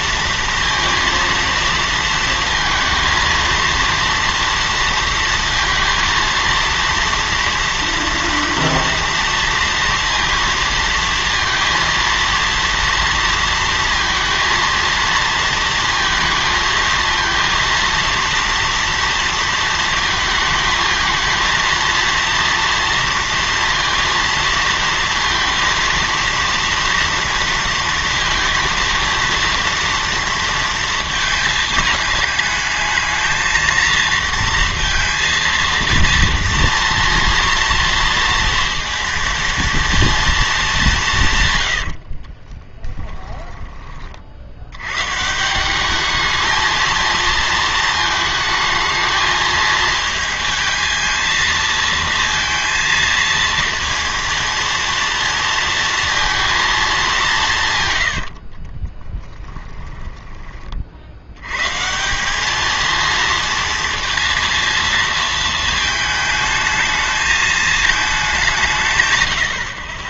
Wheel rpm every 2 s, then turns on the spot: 230, 230, 230, 230, 230, 230, 230, 230, 230, 230, 220, 230, 230, 230, 230, 230, 210, 230, 230, 230, 210, 30, 90, 220, 220, 220, 230, 230, 220, 40, 30, 210, 230, 220, 160.
42-44 58-60